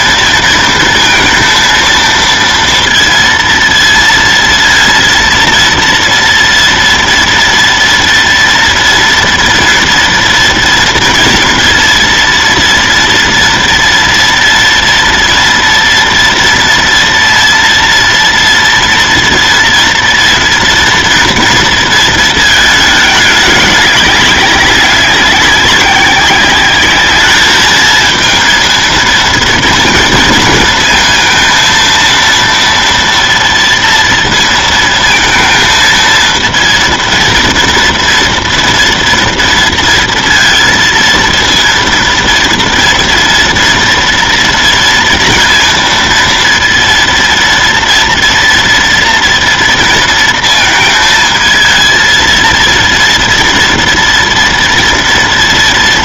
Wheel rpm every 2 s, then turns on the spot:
230, 230, 230, 240, 230, 230, 230, 230, 230, 230, 230, 210, 200, 200, 220, 230, 230, 230, 230, 230, 230, 230, 230, 230, 230, 220, 230, 230.
none